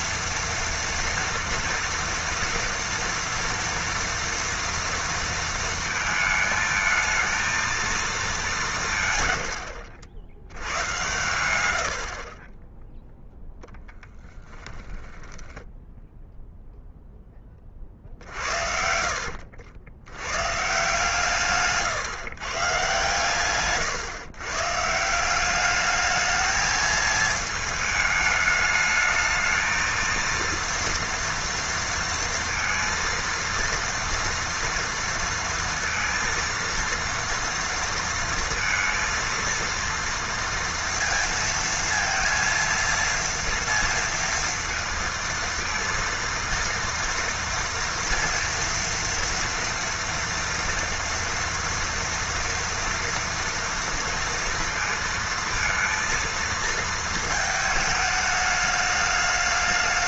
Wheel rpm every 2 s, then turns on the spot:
230, 230, 230, 220, 170, 90, 10, 10, 0, 60, 150, 130, 140, 220, 210, 230, 230, 230, 230, 230, 230, 230, 230, 230, 230, 230, 230, 230, 230, 210.
14-16